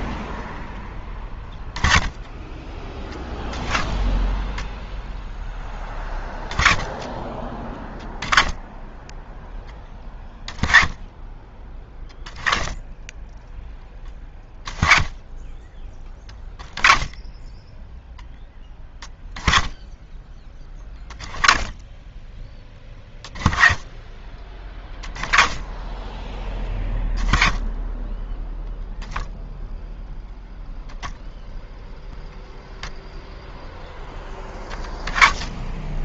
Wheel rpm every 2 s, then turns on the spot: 10, 10, 0, 20, 10, 20, 10, 10, 20, 20, 20, 10, 10, 10, 0, 0, 0, 10.
none